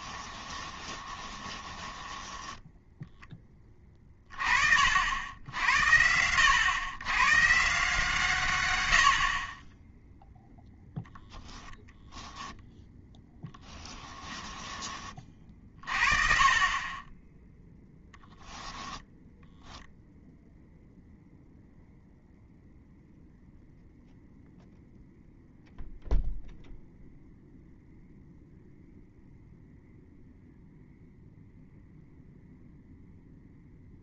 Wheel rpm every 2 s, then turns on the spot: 20, 10, 50, 100, 120, 10, 10, 20, 30, 10, 0, 0, 0, 0, 0, 0, 0.
0-4